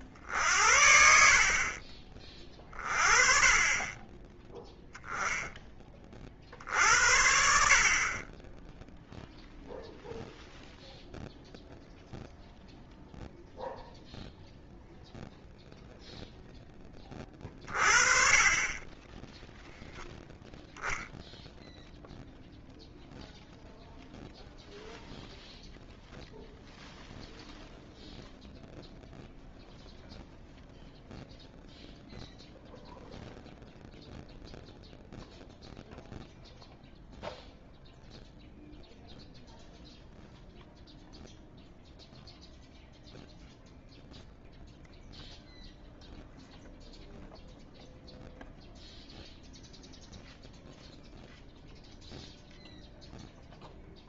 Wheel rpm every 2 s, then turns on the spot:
60, 30, 10, 60, 0, 0, 0, 0, 10, 20, 0, 0, 0, 0, 0, 0, 0, 0, 0, 0, 0, 0, 0, 0, 0, 0, 0.
none